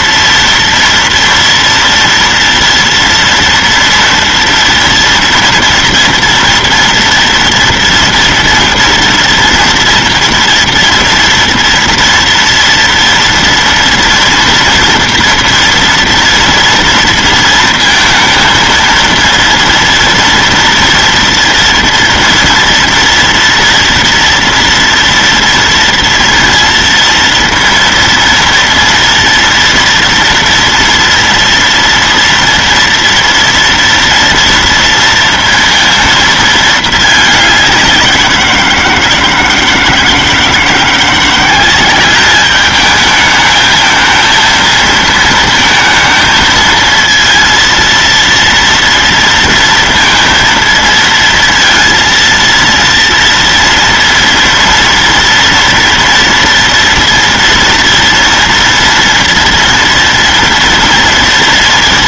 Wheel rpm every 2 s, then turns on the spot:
230, 230, 230, 230, 230, 230, 230, 230, 230, 230, 240, 230, 230, 230, 230, 230, 230, 230, 220, 170, 170, 210, 230, 230, 230, 230, 230, 230, 230, 230, 230.
none